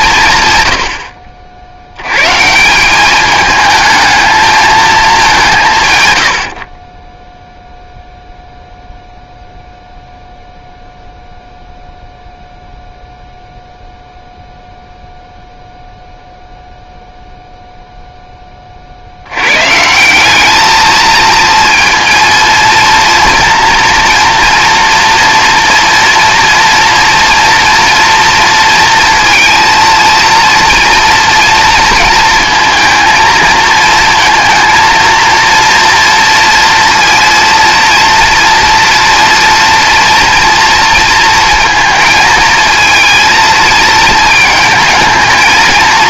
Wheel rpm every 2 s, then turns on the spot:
100, 170, 220, 60, 0, 0, 0, 0, 0, 40, 220, 230, 230, 230, 230, 230, 230, 230, 230, 230, 230, 220, 220.
none